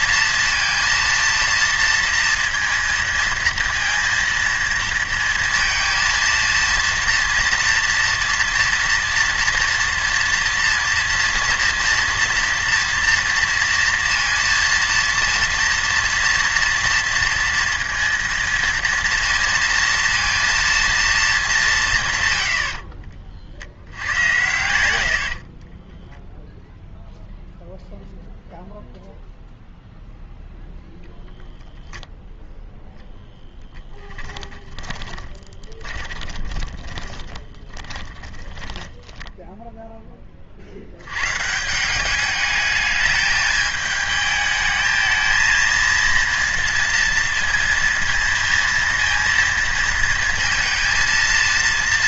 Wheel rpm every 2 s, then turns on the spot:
230, 230, 230, 230, 230, 230, 230, 230, 230, 230, 230, 70, 80, 0, 0, 0, 0, 20, 20, 10, 50, 210, 220, 230, 230, 230.
34-40